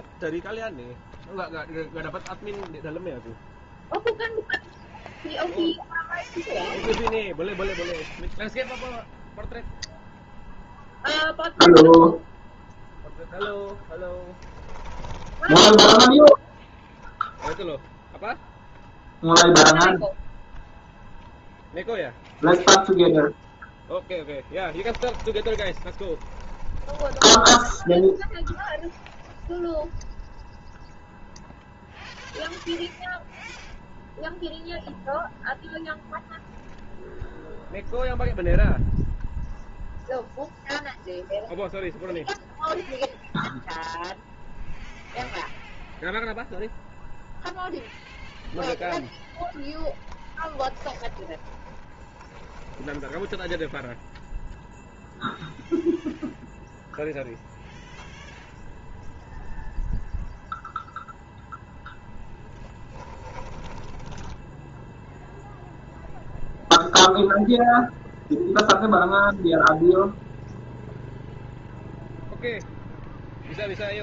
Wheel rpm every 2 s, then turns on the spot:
0, 0, 0, 0, 0, 0, 0, 10, 0, 0, 0, 0, 10, 10, 0, 0, 0, 0, 0, 0, 0, 0, 0, 0, 0, 10, 10, 0, 0, 0, 0, 10, 0, 0, 0, 0, 0.
14-16 24-28 50-54 62-64